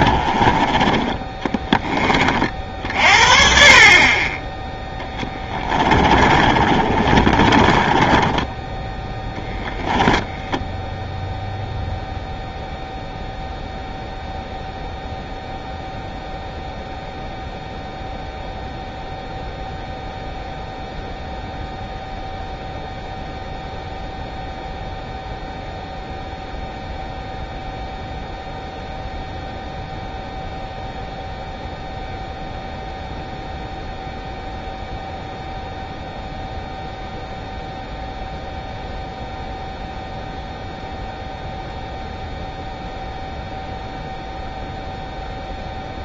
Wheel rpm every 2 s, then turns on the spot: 20, 50, 10, 30, 10, 0, 0, 0, 0, 0, 0, 0, 0, 0, 0, 0, 0, 0, 0, 0, 0, 0, 0.
6-10